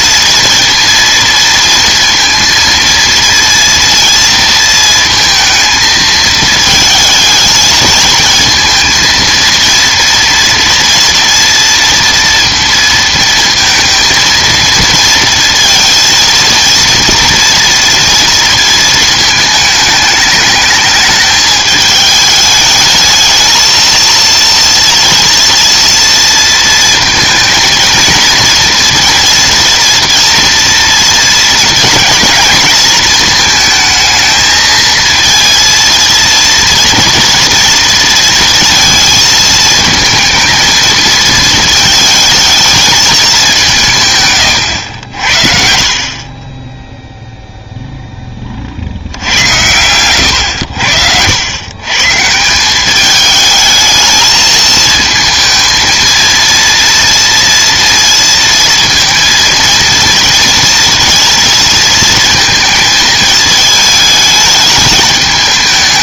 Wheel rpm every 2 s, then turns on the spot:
230, 230, 230, 220, 230, 230, 230, 230, 230, 230, 220, 210, 230, 230, 230, 230, 230, 220, 230, 230, 220, 220, 100, 10, 50, 80, 180, 220, 230, 230, 230, 220, 210.
46-48